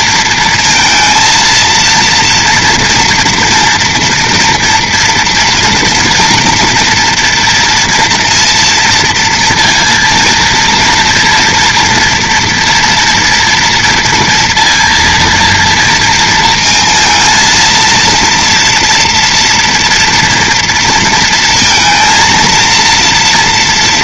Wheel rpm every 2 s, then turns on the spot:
230, 230, 240, 230, 230, 230, 230, 230, 230, 230, 230, 230.
none